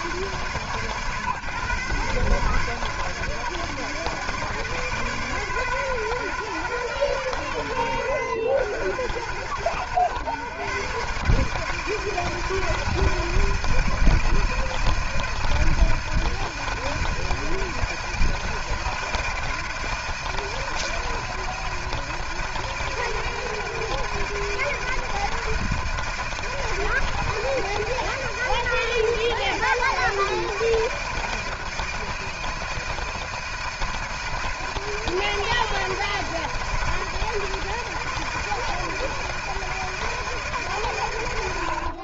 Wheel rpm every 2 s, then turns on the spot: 150, 140, 150, 130, 90, 110, 160, 160, 160, 160, 160, 160, 160, 160, 160, 160, 160, 160, 160, 160, 160.
none